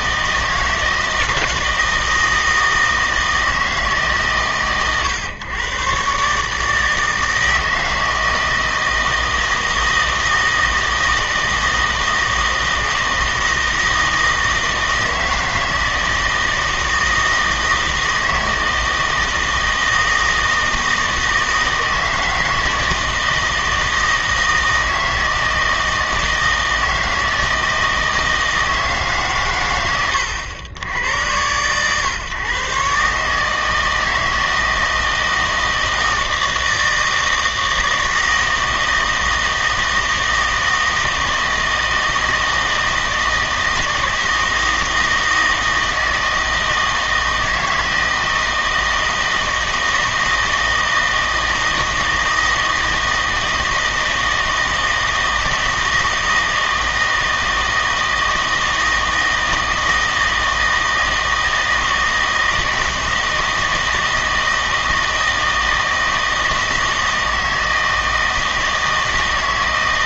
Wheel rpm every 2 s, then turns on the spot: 160, 160, 130, 150, 160, 160, 160, 160, 160, 160, 160, 160, 160, 160, 160, 100, 130, 160, 160, 160, 160, 160, 160, 160, 160, 160, 160, 160, 160, 160, 160, 160, 160, 160, 160.
none